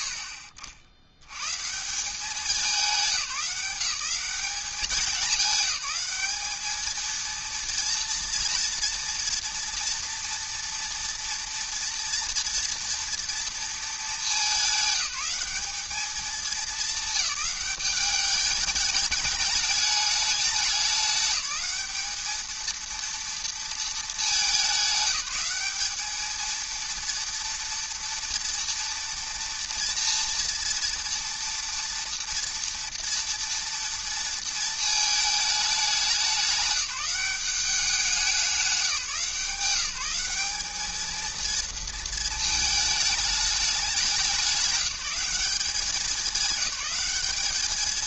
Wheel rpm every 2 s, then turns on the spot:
70, 190, 200, 210, 230, 230, 230, 200, 220, 210, 200, 230, 200, 230, 230, 240, 230, 220, 190, 180, 210, 220, 200, 210.
none